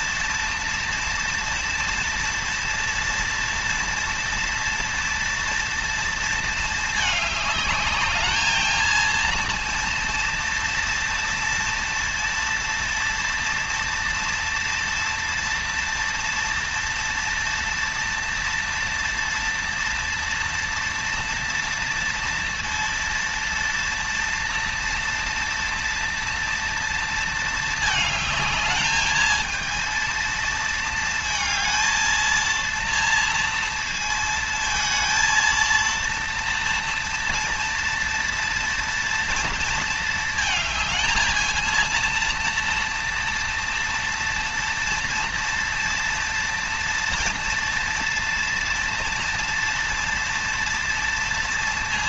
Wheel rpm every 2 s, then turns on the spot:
230, 230, 240, 220, 220, 230, 230, 230, 230, 230, 230, 230, 230, 230, 220, 230, 230, 230, 230, 230, 220, 230, 230, 230, 230, 230.
none